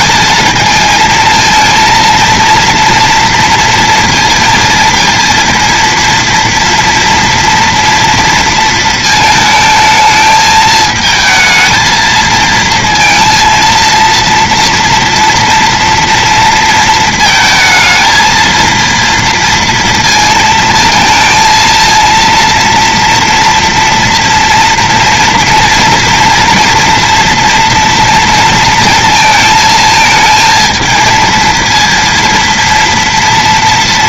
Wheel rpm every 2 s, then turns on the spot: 220, 230, 230, 230, 230, 220, 230, 230, 230, 230, 230, 230, 230, 230, 230, 220, 230.
none